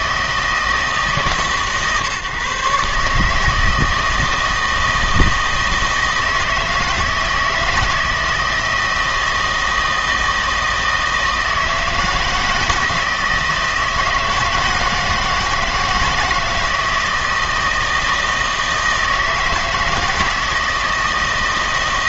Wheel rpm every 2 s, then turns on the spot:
160, 140, 160, 160, 160, 160, 160, 160, 160, 160, 160.
none